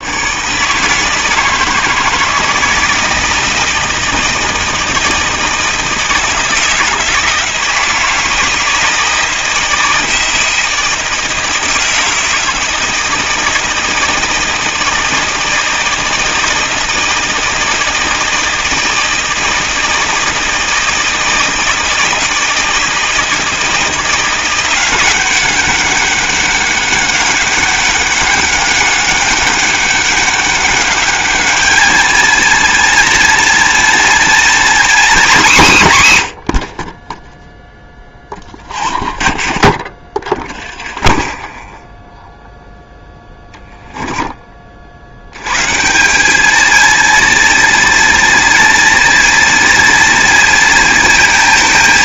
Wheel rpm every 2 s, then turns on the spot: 160, 160, 160, 160, 160, 160, 160, 160, 160, 160, 160, 160, 180, 200, 200, 200, 230, 250, 60, 30, 30, 0, 60, 230, 230, 230.
38-40